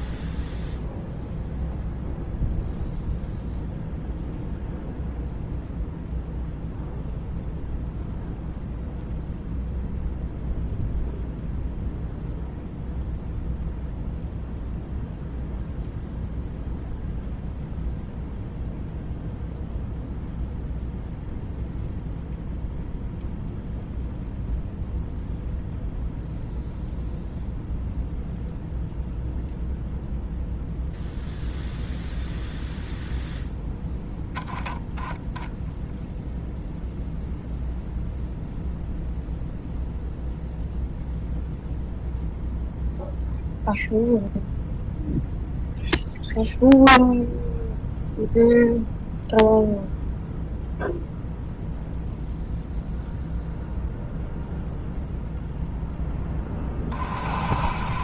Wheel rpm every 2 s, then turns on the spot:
0, 0, 0, 0, 0, 0, 0, 0, 0, 0, 0, 0, 0, 0, 0, 0, 0, 10, 0, 0, 0, 0, 0, 0, 0, 0, 0, 0, 30.
none